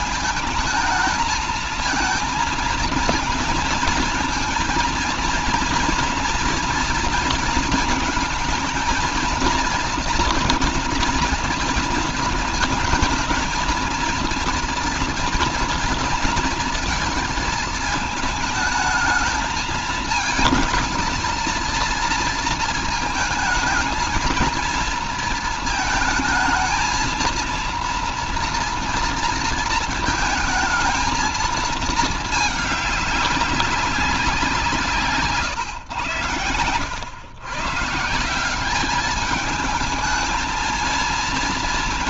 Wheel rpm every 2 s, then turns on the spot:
220, 230, 230, 230, 220, 240, 230, 230, 230, 220, 220, 230, 230, 220, 240, 220, 210, 180, 110, 190, 230.
none